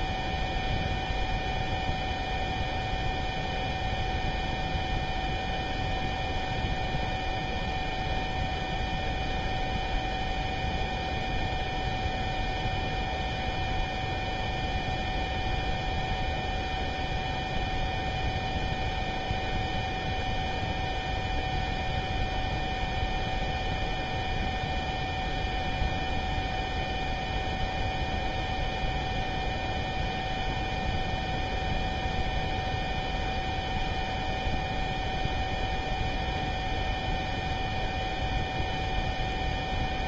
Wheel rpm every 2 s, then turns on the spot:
0, 0, 0, 0, 0, 0, 0, 0, 0, 0, 0, 0, 0, 0, 0, 0, 0, 0, 0, 0.
none